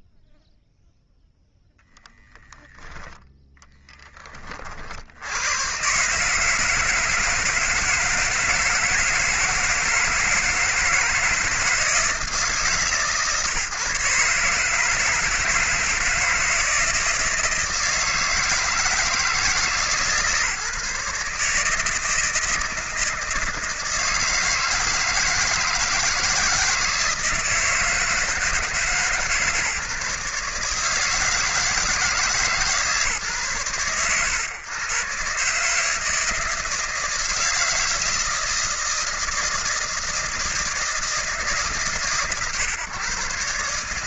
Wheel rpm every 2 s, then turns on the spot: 0, 0, 20, 150, 160, 160, 150, 150, 160, 160, 150, 160, 160, 160, 160, 150, 160, 110, 160, 160, 160, 120.
none